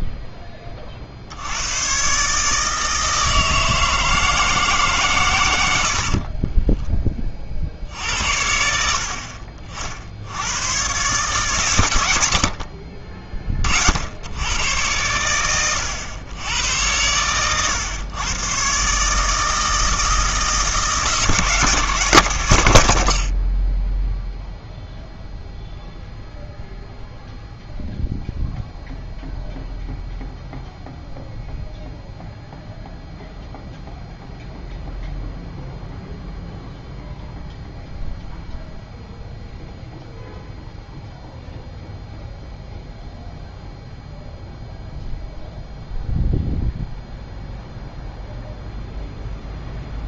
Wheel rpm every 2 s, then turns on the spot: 30, 150, 140, 20, 60, 110, 40, 100, 100, 130, 160, 110, 0, 0, 0, 0, 0, 0, 0, 0, 0, 0, 0, 0, 0.
6-8